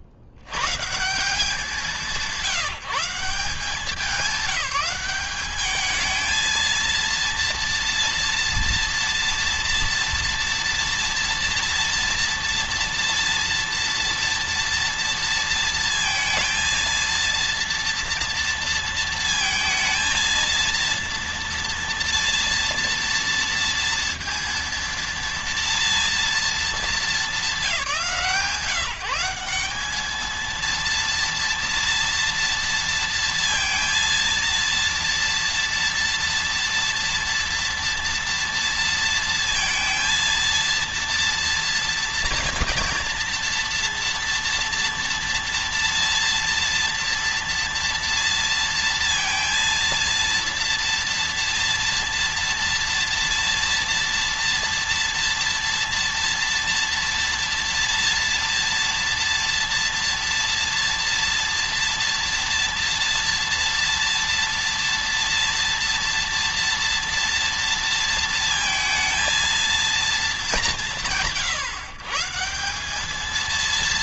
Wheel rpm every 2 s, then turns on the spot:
170, 180, 200, 230, 230, 230, 230, 230, 230, 230, 230, 230, 230, 200, 170, 230, 230, 230, 230, 230, 230, 230, 230, 230, 230, 230, 230, 230, 230, 230, 230, 230, 230, 230, 230, 150, 200.
none